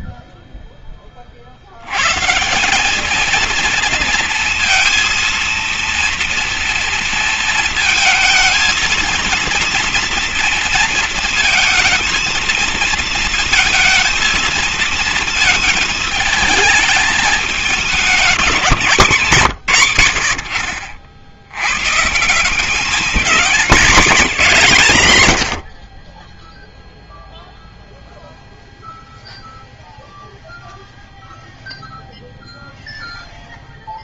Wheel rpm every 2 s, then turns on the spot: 30, 220, 230, 230, 230, 230, 220, 230, 220, 170, 60, 220, 130, 0, 0, 0, 0.
none